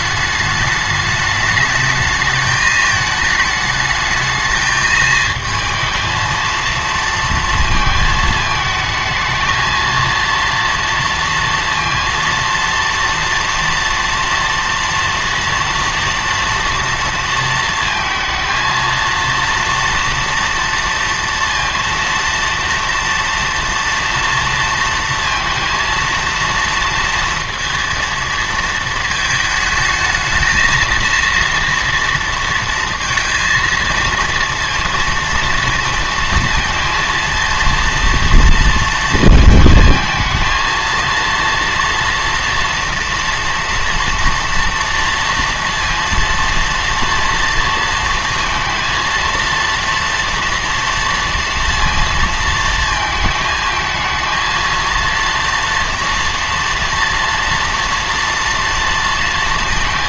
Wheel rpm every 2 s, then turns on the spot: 210, 220, 220, 230, 220, 230, 230, 230, 230, 230, 230, 230, 230, 230, 220, 220, 230, 230, 230, 220, 220, 240, 230, 230, 230, 230, 220, 230, 230, 230.
none